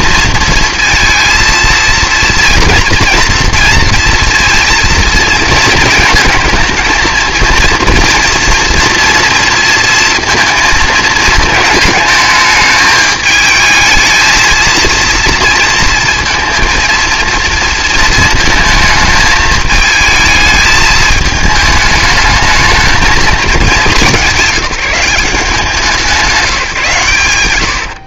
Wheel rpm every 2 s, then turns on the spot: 230, 230, 230, 220, 230, 230, 220, 220, 230, 220, 220, 220, 190, 170.
none